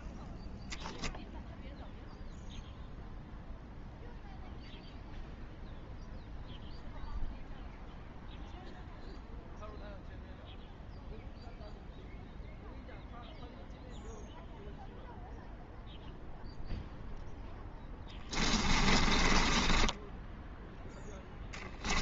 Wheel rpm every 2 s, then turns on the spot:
0, 0, 0, 0, 0, 0, 0, 0, 0, 30, 10.
18-20